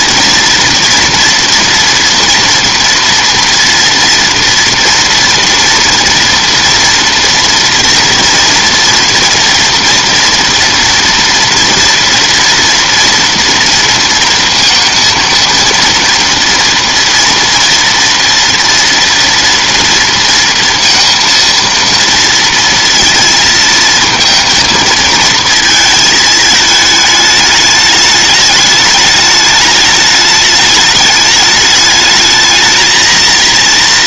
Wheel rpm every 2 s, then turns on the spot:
240, 230, 230, 230, 230, 230, 230, 230, 230, 230, 230, 230, 230, 220, 210, 210, 210.
none